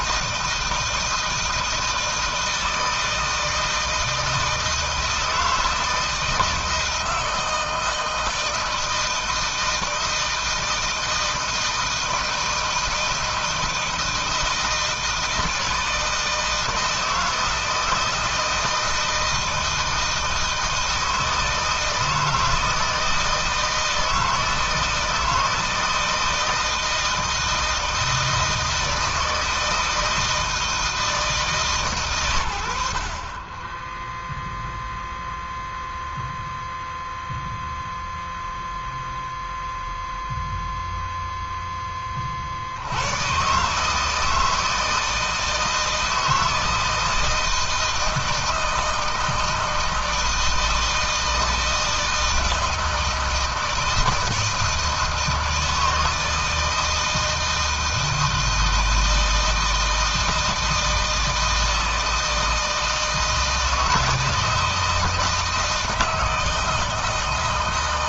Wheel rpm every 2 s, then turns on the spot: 160, 160, 160, 160, 160, 160, 160, 160, 160, 160, 160, 160, 160, 160, 160, 150, 40, 0, 0, 0, 0, 110, 160, 160, 160, 160, 160, 160, 160, 160, 160, 160, 160, 160.
none